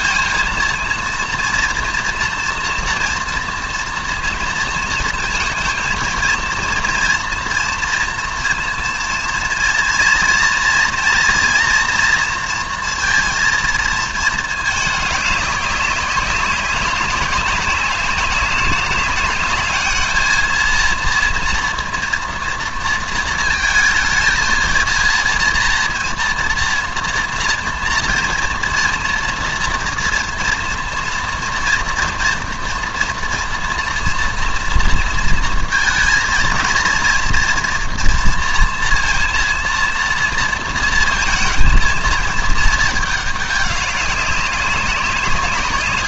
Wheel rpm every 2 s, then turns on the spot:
230, 230, 230, 230, 230, 230, 230, 220, 200, 200, 230, 230, 230, 230, 230, 230, 230, 230, 230, 230, 230, 220, 190.
none